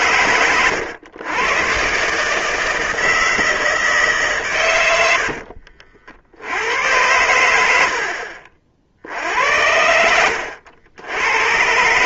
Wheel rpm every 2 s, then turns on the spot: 120, 160, 130, 80, 50, 80.
none